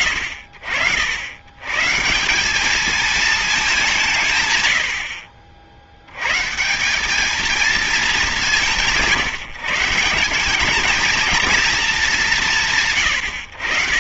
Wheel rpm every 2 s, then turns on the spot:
60, 190, 100, 150, 170, 200, 120.
none